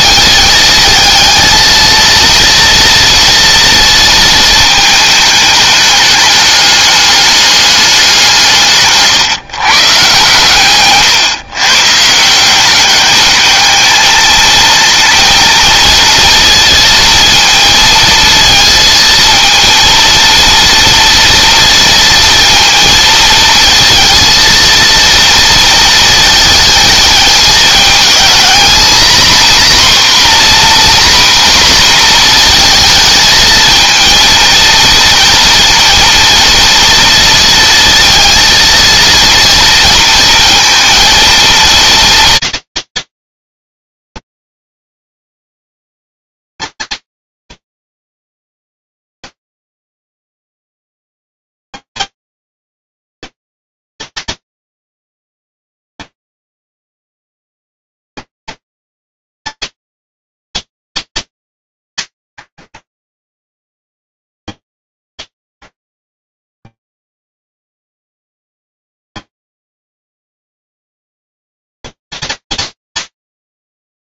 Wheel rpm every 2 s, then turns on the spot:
220, 230, 220, 210, 150, 140, 200, 230, 230, 230, 230, 230, 230, 220, 250, 250, 220, 230, 230, 230, 230, 230, 220, 210, 100, 170, 230, 230, 230, 230, 230, 90, 130, 0, 130, 230, 230.
8-10